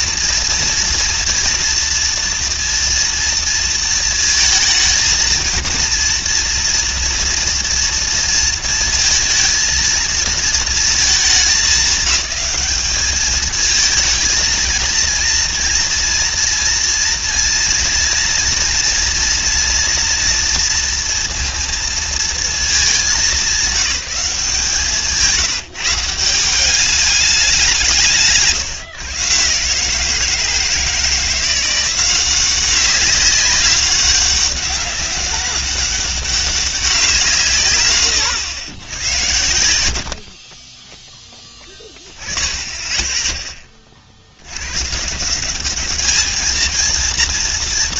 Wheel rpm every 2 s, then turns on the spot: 230, 230, 220, 230, 230, 220, 200, 230, 230, 230, 230, 220, 170, 180, 150, 160, 190, 200, 200, 100, 40, 10, 90, 220.
none